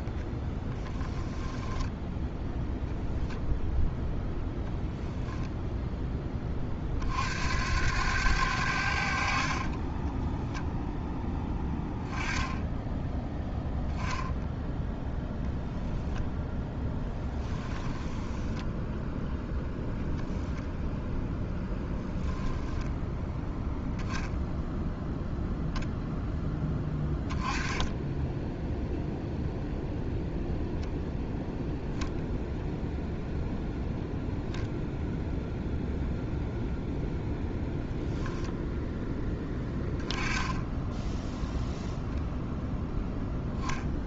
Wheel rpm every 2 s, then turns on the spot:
10, 0, 10, 40, 70, 0, 10, 10, 10, 0, 0, 0, 0, 10, 0, 0, 0, 10, 0, 0, 10, 0.
0-2 16-18